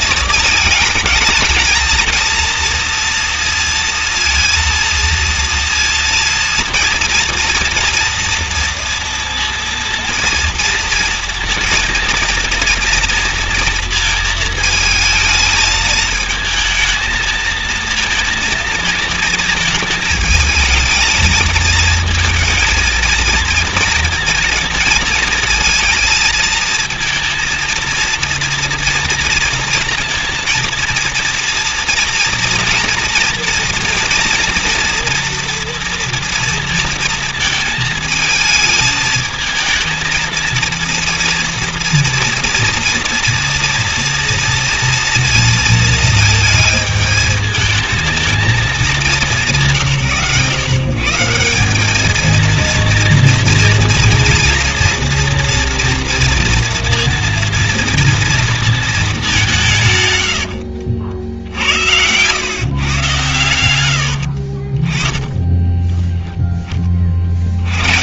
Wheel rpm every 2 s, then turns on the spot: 220, 230, 230, 230, 230, 230, 230, 220, 230, 230, 220, 230, 230, 230, 230, 230, 230, 240, 230, 220, 230, 230, 240, 220, 210, 150, 230, 240, 230, 230, 80, 130, 20, 40.
none